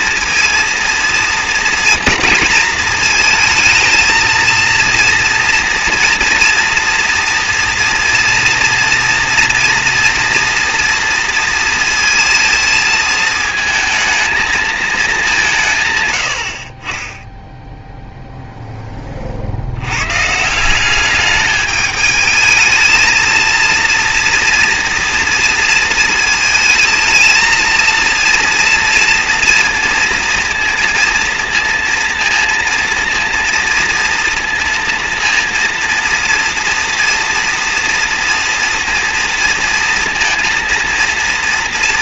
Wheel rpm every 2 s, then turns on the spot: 230, 230, 230, 230, 230, 230, 230, 230, 50, 0, 170, 220, 230, 220, 230, 230, 230, 230, 240, 230, 230.
none